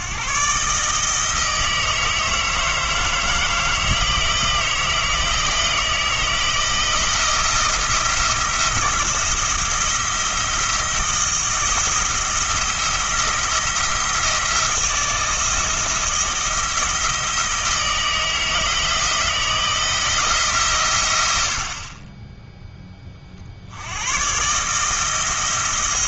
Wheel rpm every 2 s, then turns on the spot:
150, 160, 160, 170, 170, 170, 170, 170, 160, 160, 120, 10, 160.
none